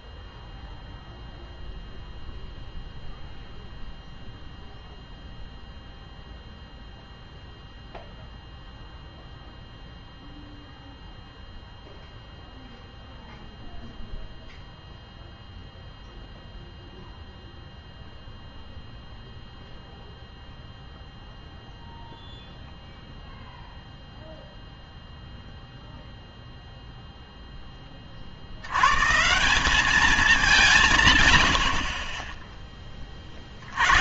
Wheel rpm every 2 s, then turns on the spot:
0, 0, 0, 0, 0, 0, 0, 0, 0, 0, 0, 0, 0, 0, 110, 170, 20.
none